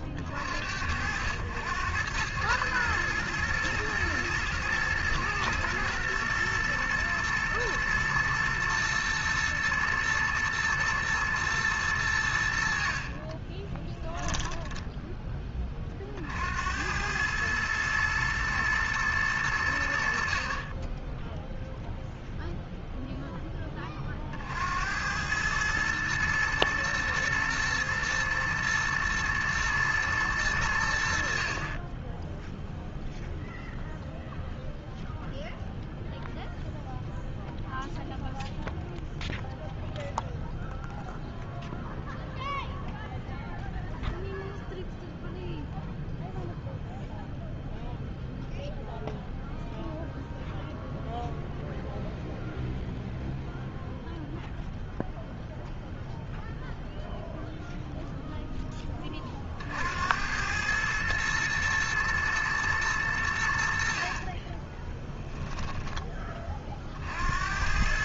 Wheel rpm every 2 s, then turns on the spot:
100, 110, 120, 120, 110, 110, 30, 20, 110, 100, 0, 10, 100, 120, 110, 50, 0, 0, 0, 0, 0, 0, 0, 0, 0, 0, 0, 0, 0, 40, 110, 90, 10, 80.
12-14 64-66